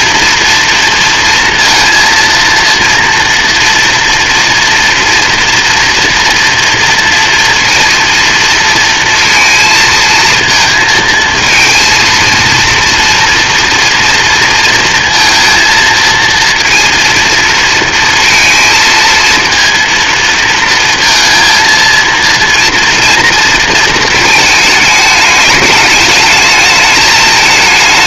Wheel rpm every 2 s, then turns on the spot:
230, 230, 230, 230, 230, 220, 230, 230, 230, 230, 230, 230, 210, 220.
none